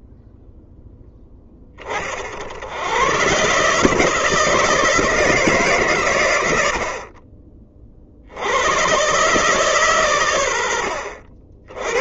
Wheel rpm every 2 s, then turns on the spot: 0, 90, 160, 80, 110, 70.
none